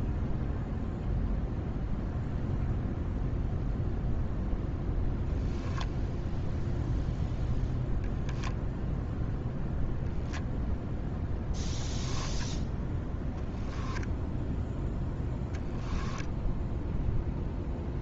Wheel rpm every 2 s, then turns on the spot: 0, 0, 0, 0, 0, 0, 10, 0, 0.
none